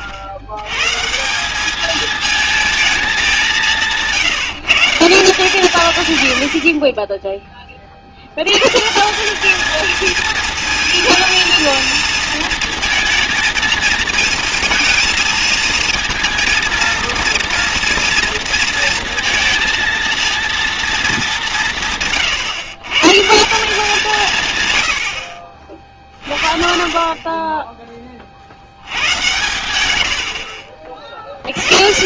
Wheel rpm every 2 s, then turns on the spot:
120, 220, 160, 60, 120, 230, 230, 230, 230, 230, 230, 130, 120, 30, 70, 60.
none